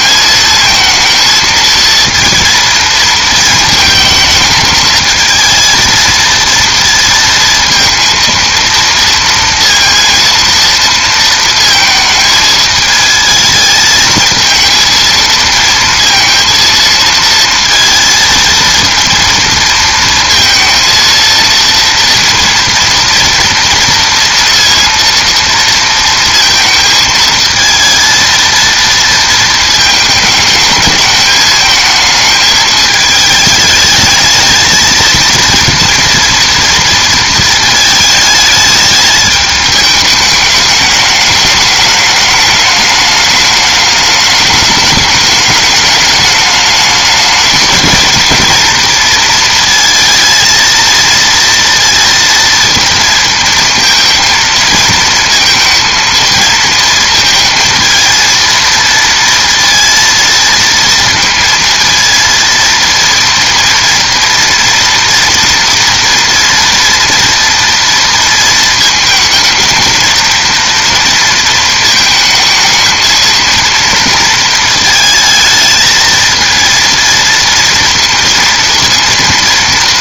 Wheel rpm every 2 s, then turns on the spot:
220, 230, 220, 230, 230, 230, 220, 230, 230, 230, 230, 240, 230, 220, 230, 210, 220, 220, 230, 210, 210, 210, 210, 210, 230, 230, 230, 220, 230, 230, 230, 230, 230, 230, 230, 230, 220, 230, 230, 230.
none